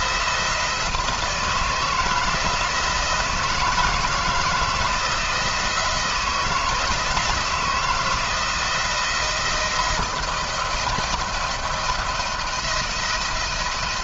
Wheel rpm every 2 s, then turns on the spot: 170, 160, 160, 160, 170, 170, 170.
none